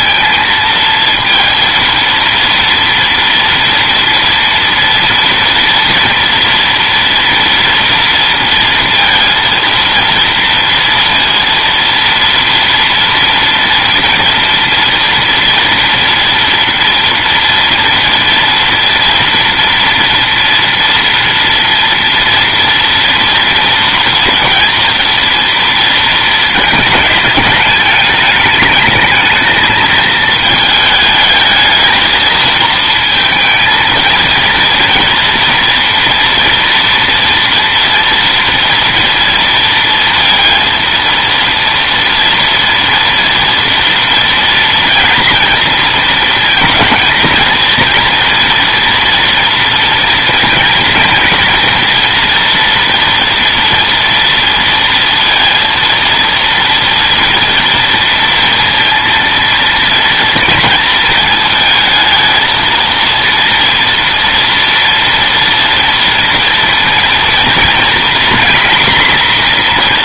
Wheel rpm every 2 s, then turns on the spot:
230, 230, 230, 230, 230, 230, 240, 230, 230, 230, 230, 230, 230, 220, 210, 220, 220, 230, 230, 230, 230, 230, 230, 230, 230, 230, 230, 230, 230, 230, 230, 230, 230, 230, 240.
none